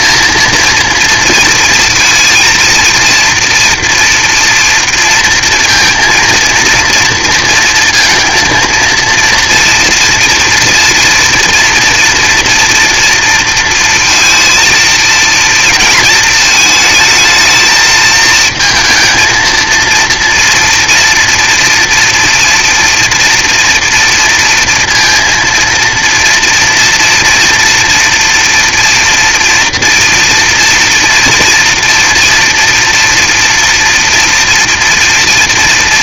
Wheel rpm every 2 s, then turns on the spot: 230, 230, 230, 230, 230, 230, 240, 230, 230, 220, 240, 230, 230, 230, 230, 230, 230, 230.
none